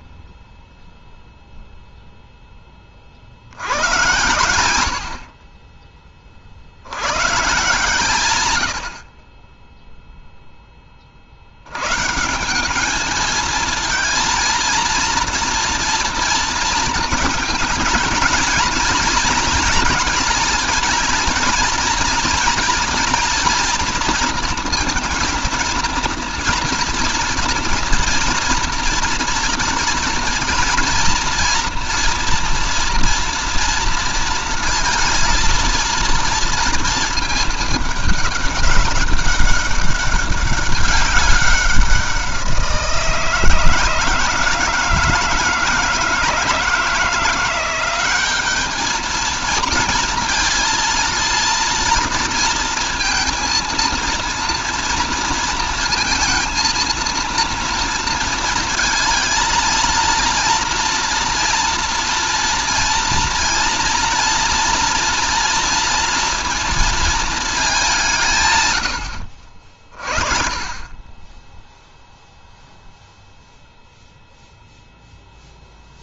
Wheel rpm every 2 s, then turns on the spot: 10, 20, 90, 70, 90, 10, 190, 230, 230, 230, 230, 230, 230, 230, 230, 230, 240, 230, 230, 200, 200, 170, 160, 170, 210, 230, 230, 230, 230, 230, 240, 230, 230, 230, 120, 40, 0, 0.
none